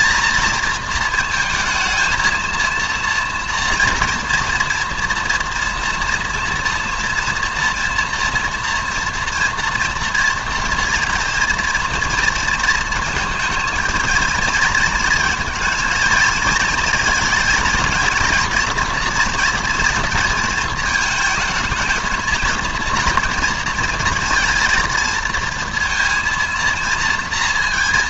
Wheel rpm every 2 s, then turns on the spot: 220, 230, 230, 230, 230, 240, 230, 220, 230, 230, 230, 230, 230, 230.
none